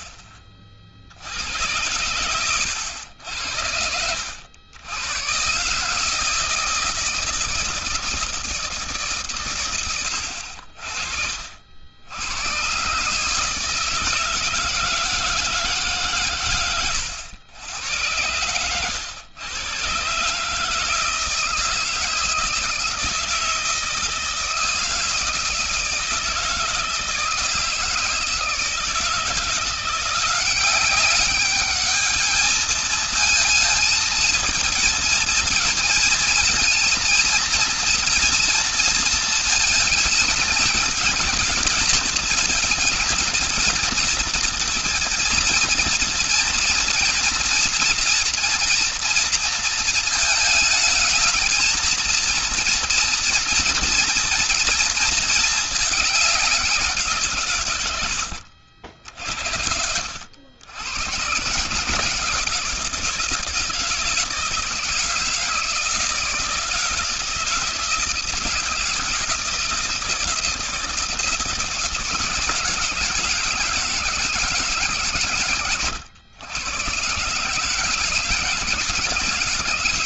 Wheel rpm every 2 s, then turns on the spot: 40, 100, 90, 160, 160, 80, 120, 160, 120, 110, 150, 160, 160, 160, 160, 190, 220, 220, 230, 230, 220, 220, 240, 230, 230, 220, 230, 230, 190, 60, 70, 160, 160, 160, 160, 170, 160, 160, 110, 170.
none